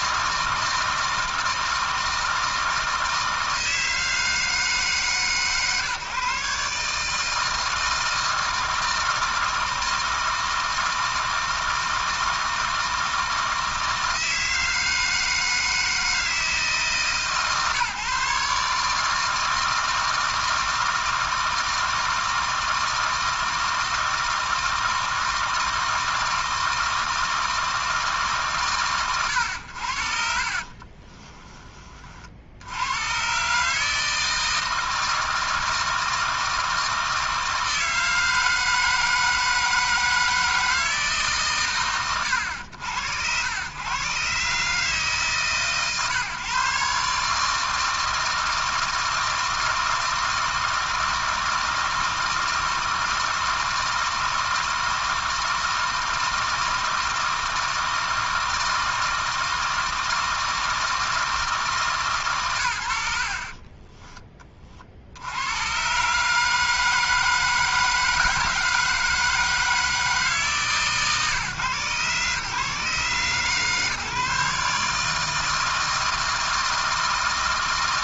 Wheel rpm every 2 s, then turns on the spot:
160, 160, 150, 150, 160, 160, 160, 160, 150, 150, 160, 160, 160, 160, 110, 40, 110, 160, 160, 160, 150, 90, 140, 140, 160, 160, 160, 160, 160, 160, 160, 70, 70, 160, 160, 140, 130, 150, 160.
30-32